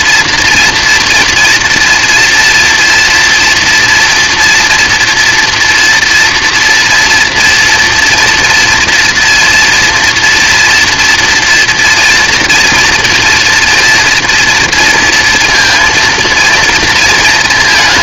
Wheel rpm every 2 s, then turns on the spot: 230, 230, 230, 240, 240, 230, 230, 230, 230.
none